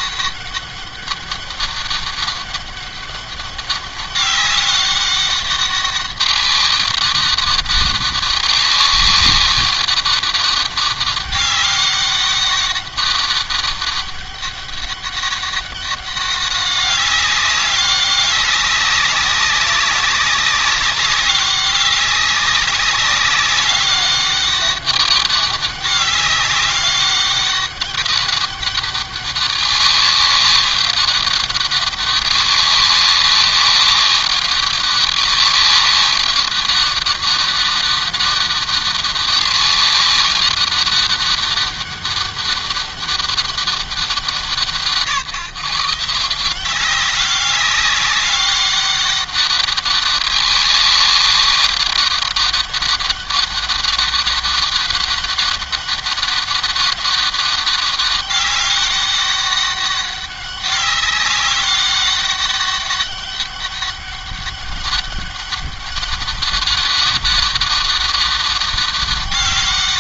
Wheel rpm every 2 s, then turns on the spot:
200, 200, 200, 200, 200, 200, 200, 200, 200, 200, 200, 200, 200, 200, 200, 200, 200, 200, 200, 200, 200, 200, 170, 190, 200, 200, 200, 200, 200, 200, 200, 200, 200, 190, 200.
none